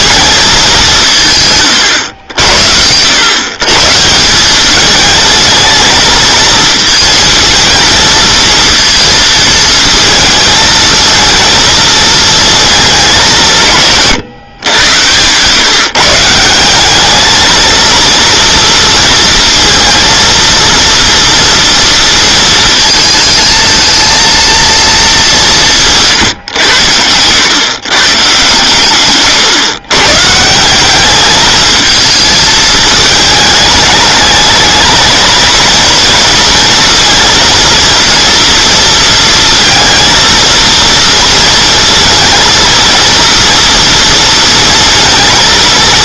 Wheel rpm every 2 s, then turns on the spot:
220, 80, 200, 230, 230, 220, 220, 130, 180, 230, 230, 220, 230, 110, 150, 170, 220, 210, 230, 230, 230, 230, 230.
none